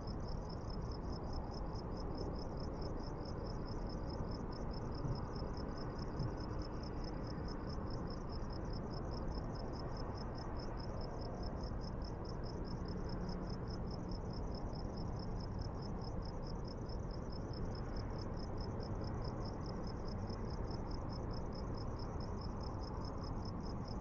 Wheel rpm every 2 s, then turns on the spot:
0, 0, 0, 0, 0, 0, 0, 0, 0, 0, 0, 0.
none